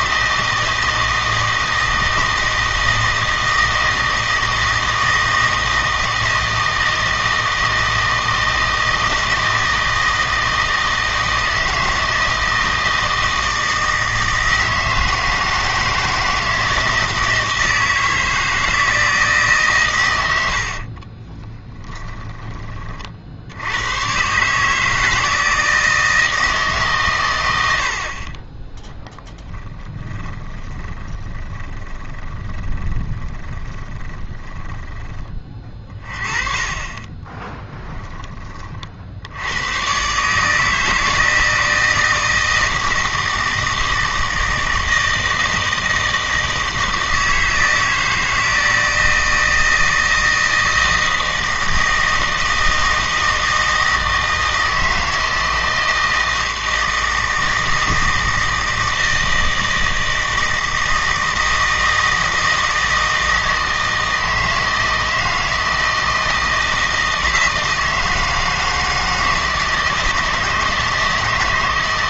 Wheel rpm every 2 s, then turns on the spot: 160, 160, 160, 160, 160, 160, 160, 160, 160, 160, 70, 30, 150, 150, 10, 20, 20, 10, 30, 30, 160, 160, 160, 160, 160, 160, 160, 160, 160, 160, 160, 160, 160, 160, 160, 160.
20-22 30-34